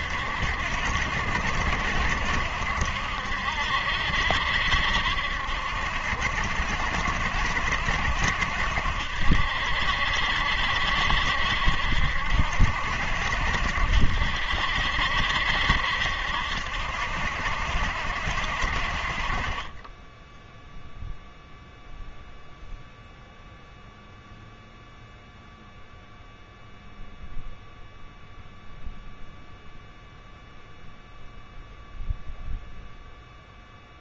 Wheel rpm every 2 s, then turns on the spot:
70, 70, 70, 70, 70, 70, 70, 70, 70, 60, 0, 0, 0, 0, 0, 0, 0.
none